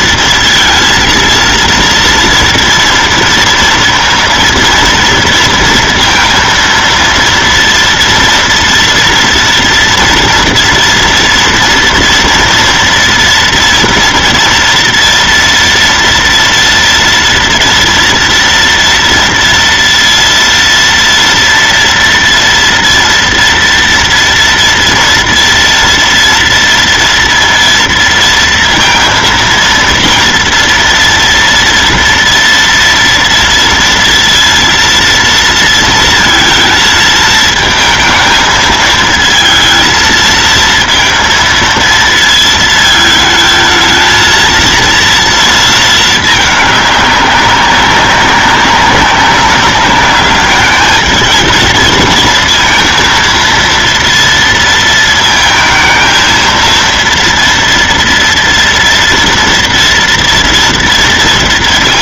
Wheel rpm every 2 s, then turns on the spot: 230, 230, 230, 230, 230, 240, 230, 230, 230, 230, 230, 230, 230, 230, 230, 230, 240, 230, 220, 220, 230, 220, 230, 210, 190, 210, 230, 230, 230, 230, 230.
none